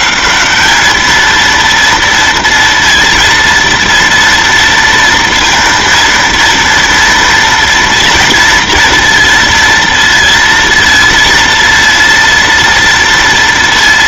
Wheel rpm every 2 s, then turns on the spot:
210, 230, 230, 230, 230, 230, 230.
none